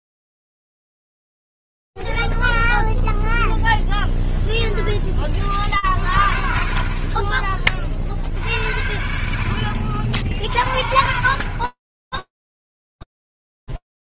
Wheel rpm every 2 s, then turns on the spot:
0, 0, 0, 40, 50, 60, 20.
none